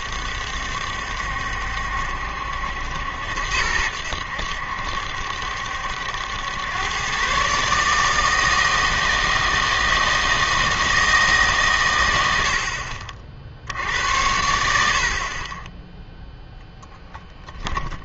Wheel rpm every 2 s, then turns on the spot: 70, 80, 70, 110, 160, 160, 70, 70, 0.
none